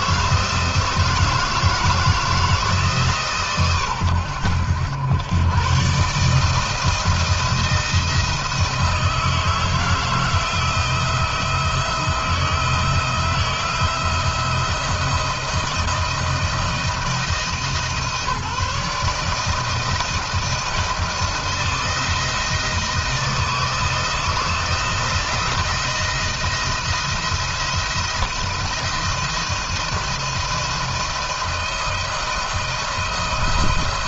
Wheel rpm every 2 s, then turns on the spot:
160, 150, 100, 160, 160, 160, 160, 160, 160, 160, 170, 160, 170, 170, 170, 160, 160.
none